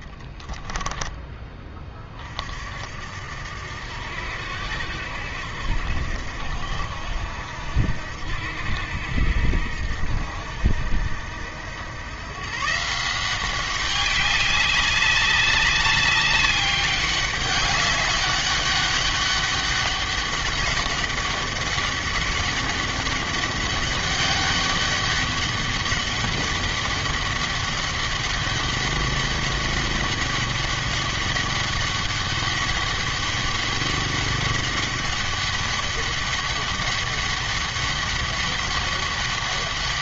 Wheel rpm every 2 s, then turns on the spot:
10, 60, 80, 80, 80, 80, 150, 200, 200, 200, 200, 200, 200, 200, 200, 200, 200, 200, 200, 200.
0-2